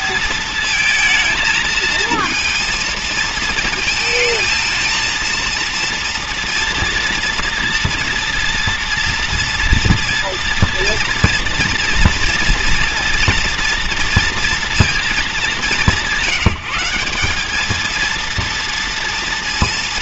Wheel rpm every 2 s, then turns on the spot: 220, 230, 220, 230, 230, 230, 230, 230, 180, 230.
none